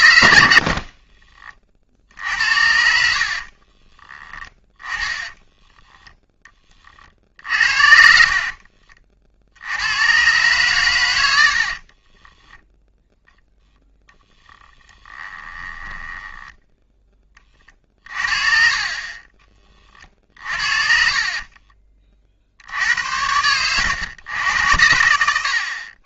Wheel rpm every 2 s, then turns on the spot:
50, 60, 20, 30, 40, 130, 10, 20, 10, 30, 40, 70, 90.
0-2 4-6 14-16 18-22